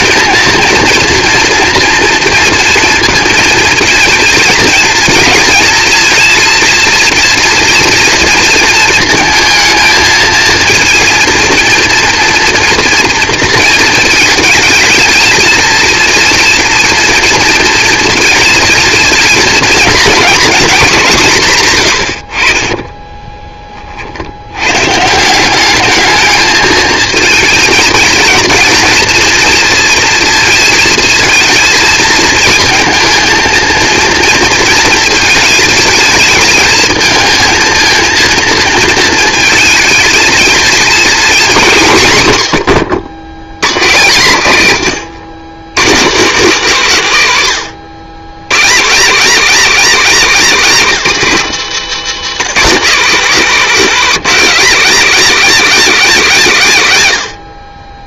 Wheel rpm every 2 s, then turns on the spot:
230, 230, 230, 230, 230, 230, 230, 230, 230, 230, 240, 40, 110, 220, 220, 220, 220, 230, 220, 230, 220, 100, 130, 180, 140, 210, 200, 230, 160.
50-52